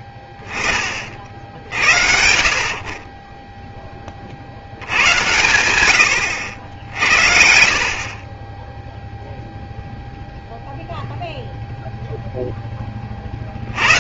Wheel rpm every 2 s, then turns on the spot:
10, 50, 80, 70, 10, 0, 10.
none